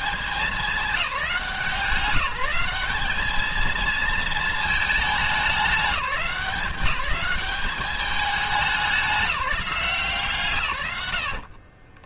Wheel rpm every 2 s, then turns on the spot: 200, 200, 210, 180, 200, 120.
none